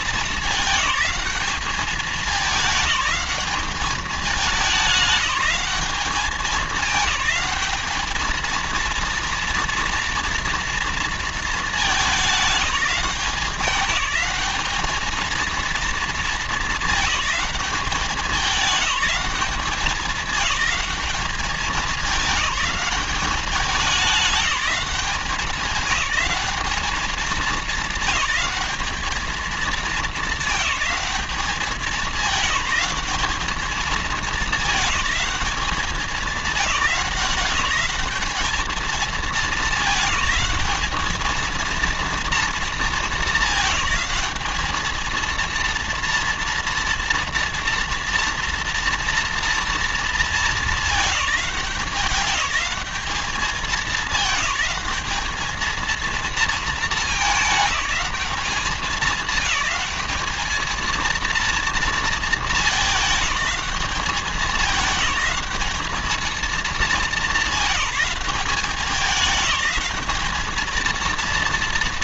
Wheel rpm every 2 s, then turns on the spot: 210, 210, 190, 210, 230, 230, 200, 220, 210, 190, 200, 200, 200, 210, 210, 190, 200, 210, 200, 220, 220, 220, 220, 230, 230, 210, 210, 210, 200, 210, 230, 210, 190, 200, 200, 220.
none